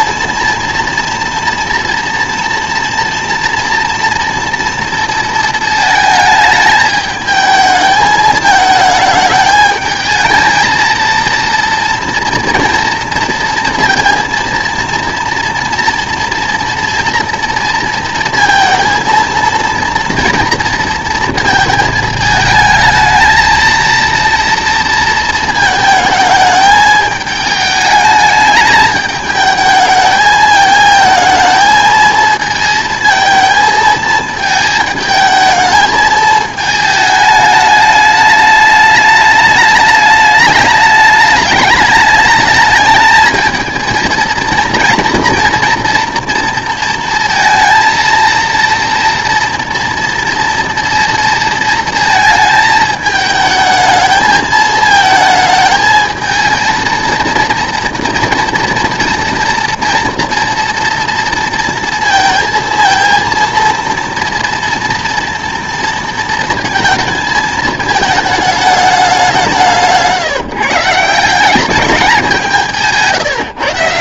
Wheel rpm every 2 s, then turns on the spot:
240, 230, 230, 210, 220, 220, 230, 230, 240, 230, 230, 220, 230, 210, 210, 220, 220, 220, 220, 210, 210, 210, 230, 230, 230, 230, 220, 220, 220, 230, 230, 230, 230, 230, 210, 150, 160.
none